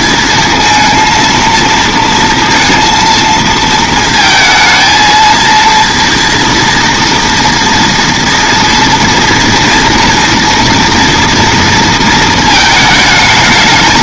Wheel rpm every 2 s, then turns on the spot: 230, 230, 220, 230, 230, 230, 220.
none